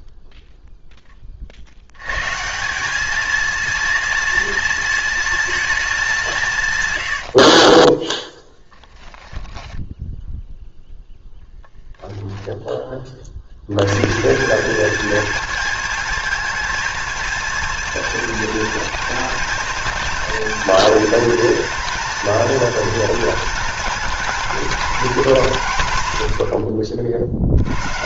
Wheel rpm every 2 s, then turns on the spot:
10, 190, 230, 120, 0, 0, 20, 210, 220, 230, 230, 230, 240, 80.
6-8